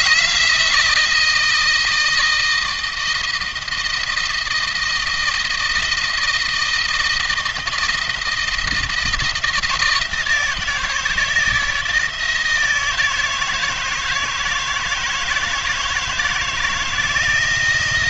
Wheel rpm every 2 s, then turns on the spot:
160, 170, 170, 160, 160, 160, 160, 160, 160.
none